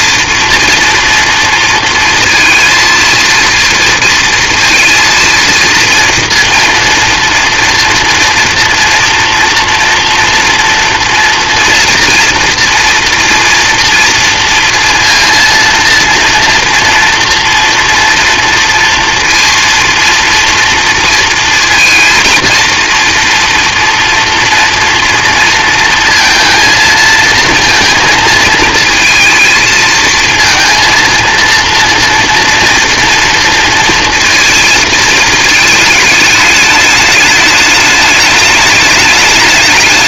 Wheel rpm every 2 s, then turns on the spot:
240, 230, 230, 240, 230, 230, 230, 230, 230, 230, 230, 230, 230, 230, 230, 230, 230, 220, 210, 210.
none